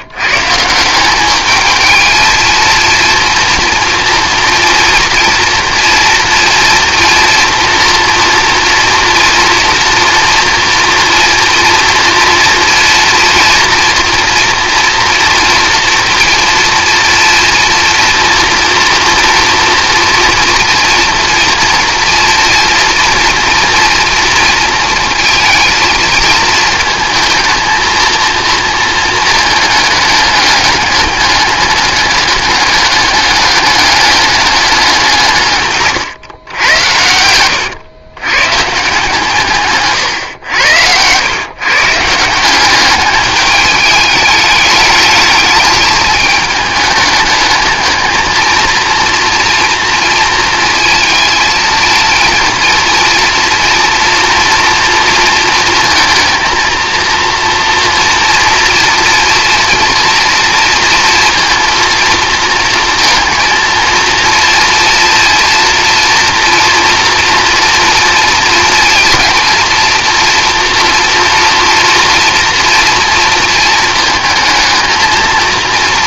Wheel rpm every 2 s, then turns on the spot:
170, 230, 240, 230, 230, 230, 230, 230, 230, 230, 230, 230, 230, 220, 230, 210, 200, 190, 90, 140, 100, 190, 210, 210, 230, 230, 230, 230, 230, 230, 230, 230, 230, 230, 230, 240, 230, 220.
none